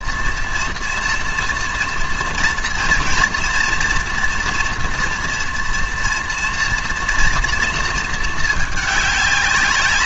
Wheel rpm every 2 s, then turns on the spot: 230, 230, 230, 240, 210.
none